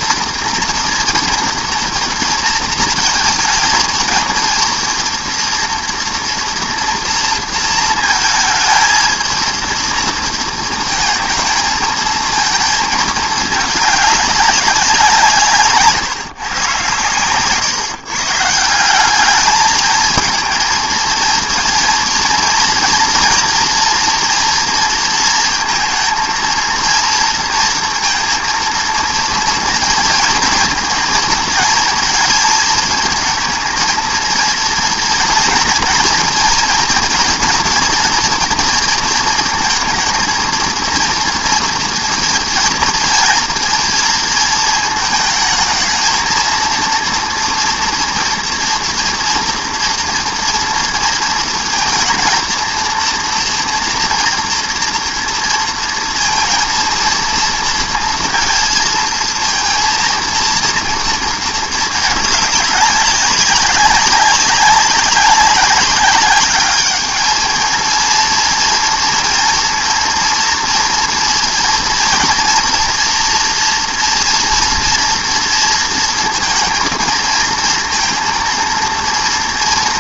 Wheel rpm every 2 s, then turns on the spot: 230, 230, 230, 230, 220, 230, 220, 190, 120, 180, 220, 230, 230, 230, 230, 230, 220, 230, 240, 230, 230, 230, 220, 230, 230, 230, 230, 230, 230, 230, 230, 200, 200, 210, 230, 230, 230, 230, 230, 230.
none